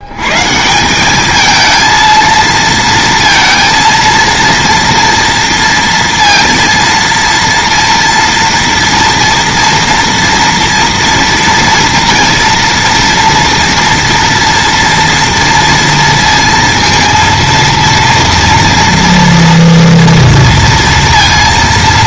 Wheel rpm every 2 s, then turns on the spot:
160, 230, 230, 230, 230, 230, 240, 240, 230, 230, 230.
none